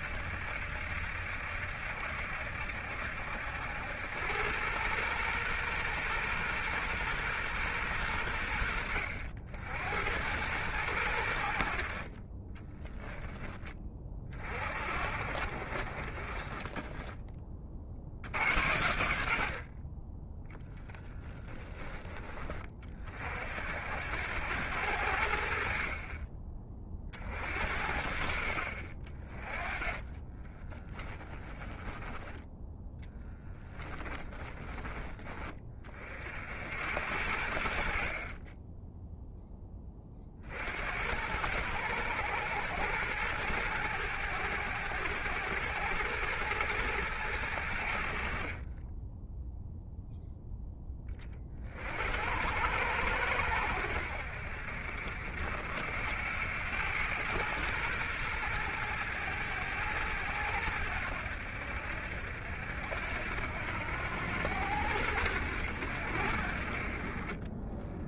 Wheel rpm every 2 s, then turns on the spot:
70, 70, 110, 120, 80, 100, 10, 50, 10, 80, 30, 50, 80, 40, 50, 10, 10, 20, 70, 10, 90, 110, 100, 100, 20, 20, 100, 60, 100, 110, 90, 70, 100, 50.
12-14 16-18 20-22 30-34 48-50